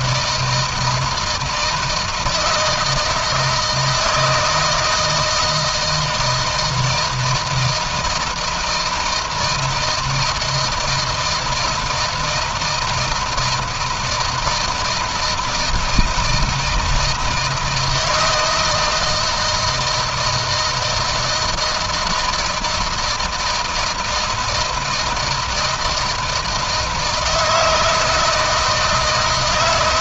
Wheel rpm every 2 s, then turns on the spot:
160, 160, 160, 160, 160, 160, 160, 160, 170, 160, 160, 160, 160, 160, 160.
none